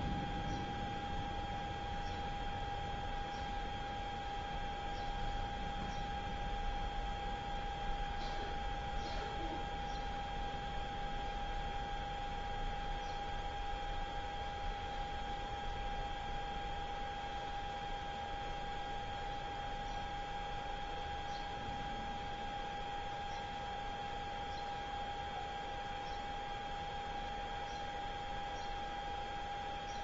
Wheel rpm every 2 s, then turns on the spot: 0, 0, 0, 0, 0, 0, 0, 0, 0, 0, 0, 0, 0, 0, 0.
none